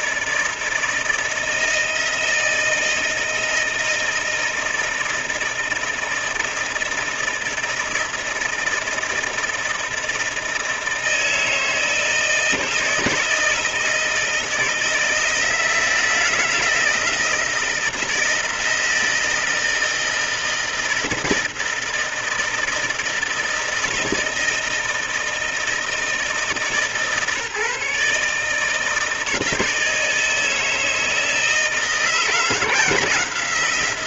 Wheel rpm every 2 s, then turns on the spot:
160, 160, 160, 160, 160, 160, 160, 160, 160, 160, 160, 160, 160, 150, 160, 160, 170.
none